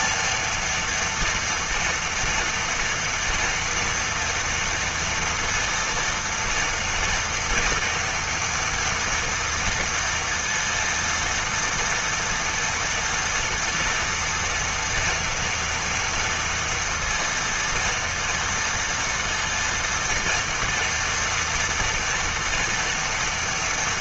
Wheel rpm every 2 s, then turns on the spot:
230, 240, 230, 230, 230, 230, 230, 240, 230, 230, 230, 230.
none